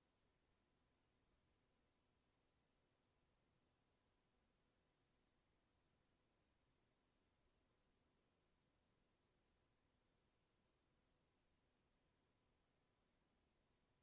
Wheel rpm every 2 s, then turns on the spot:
0, 0, 0, 0, 0, 0, 0.
none